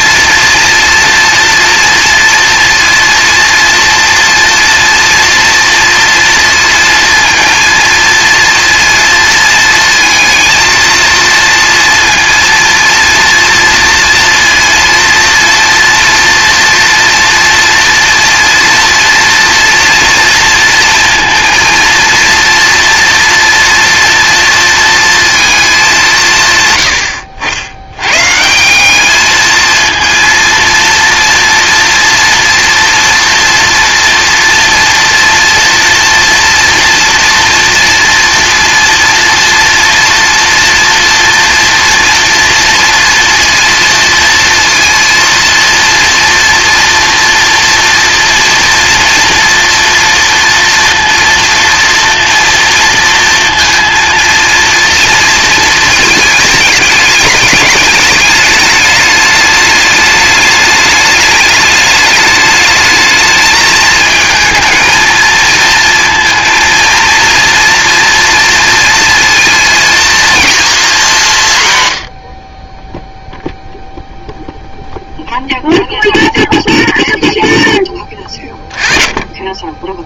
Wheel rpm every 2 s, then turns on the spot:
230, 230, 230, 230, 230, 230, 230, 230, 230, 240, 230, 230, 230, 100, 190, 230, 240, 230, 230, 230, 240, 230, 230, 230, 230, 230, 230, 230, 210, 210, 210, 220, 220, 230, 230, 210, 20, 0, 0, 20.
none